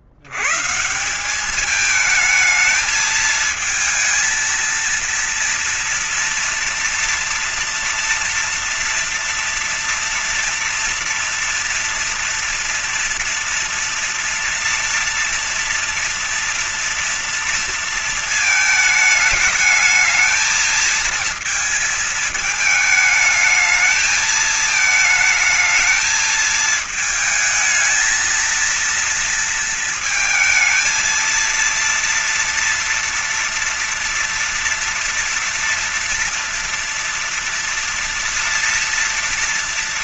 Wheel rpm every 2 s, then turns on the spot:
170, 220, 230, 240, 230, 230, 230, 230, 230, 220, 220, 220, 220, 220, 230, 230, 230, 230, 230, 240.
none